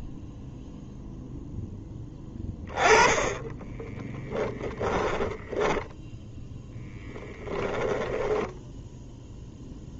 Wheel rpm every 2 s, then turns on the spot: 0, 10, 20, 10, 10.
4-6